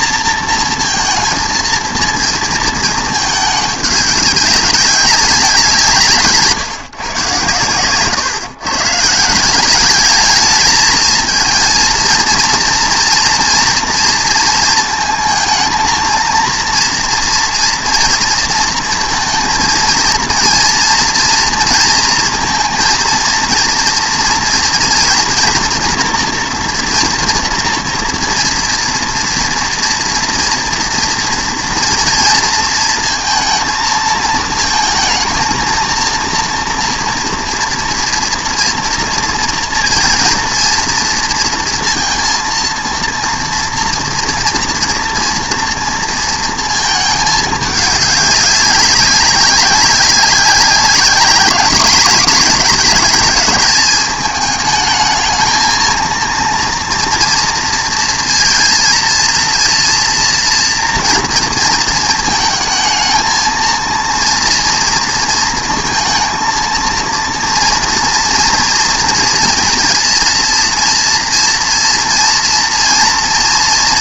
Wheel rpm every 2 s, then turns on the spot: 230, 220, 200, 130, 140, 220, 240, 220, 230, 230, 230, 230, 240, 230, 230, 230, 230, 220, 230, 230, 230, 230, 240, 220, 190, 200, 210, 220, 240, 230, 230, 220, 230, 230, 230, 230, 230.
none